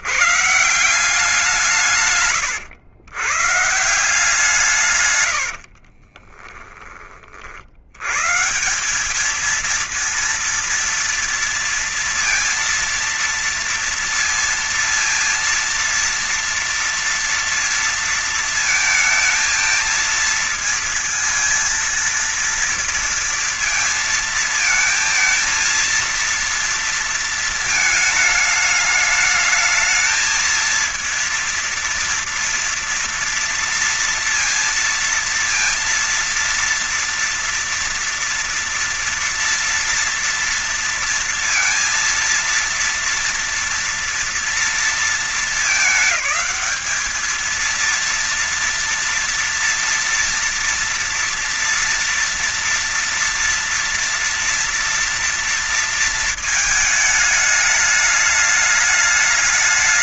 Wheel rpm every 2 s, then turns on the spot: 170, 130, 160, 30, 130, 230, 230, 230, 230, 230, 220, 230, 220, 230, 210, 220, 230, 230, 230, 230, 230, 230, 230, 210, 230, 230, 230, 240, 220, 210.
2-4 6-8